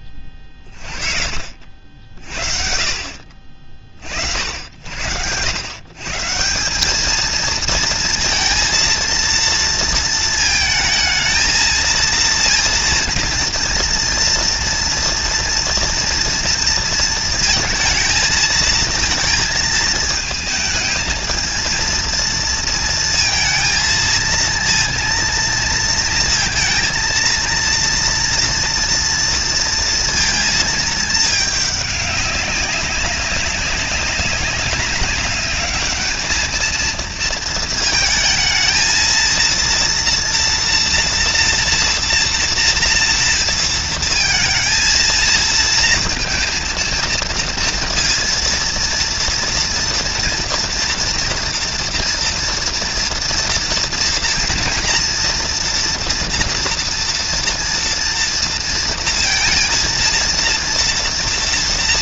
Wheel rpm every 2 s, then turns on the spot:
60, 60, 150, 230, 220, 230, 230, 230, 230, 220, 230, 230, 230, 230, 230, 200, 200, 210, 220, 240, 230, 230, 230, 230, 230, 230, 230, 230, 230, 230, 230.
none